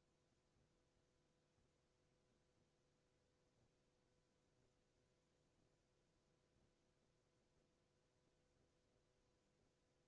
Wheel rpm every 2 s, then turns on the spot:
0, 0, 0, 0, 0.
none